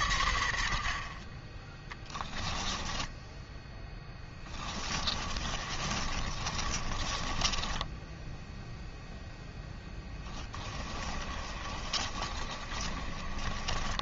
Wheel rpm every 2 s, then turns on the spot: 50, 10, 20, 30, 0, 20, 30.
2-8 10-14